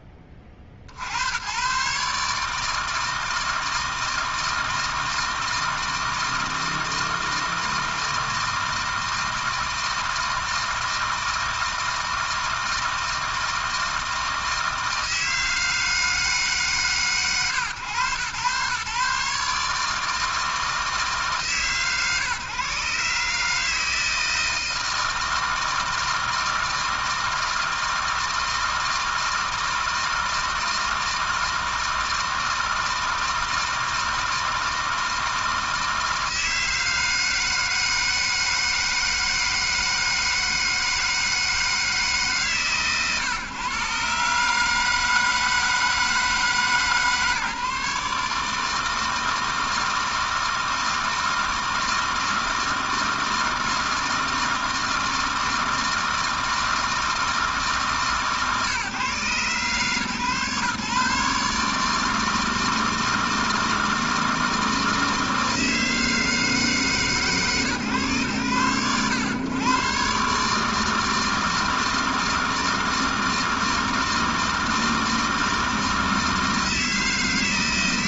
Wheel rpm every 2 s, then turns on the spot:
80, 160, 160, 160, 160, 160, 160, 160, 140, 130, 160, 140, 160, 160, 160, 160, 160, 160, 160, 160, 160, 120, 160, 150, 160, 160, 160, 160, 160, 140, 140, 160, 160, 150, 110, 160, 160, 160, 160.
none